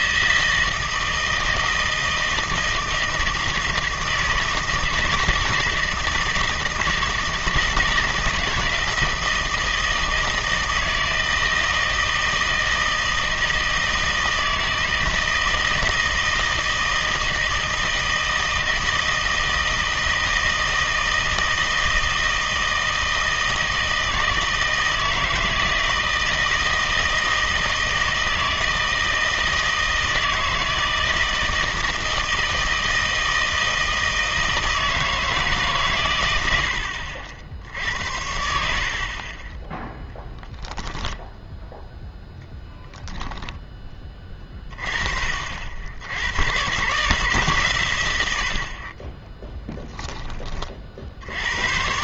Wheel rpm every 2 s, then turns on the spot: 160, 160, 160, 160, 160, 160, 160, 160, 160, 160, 160, 160, 160, 160, 160, 160, 160, 160, 70, 60, 0, 0, 30, 120, 50, 40.
none